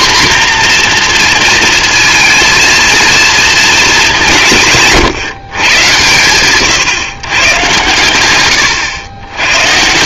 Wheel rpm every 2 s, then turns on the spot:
250, 230, 150, 130, 100.
none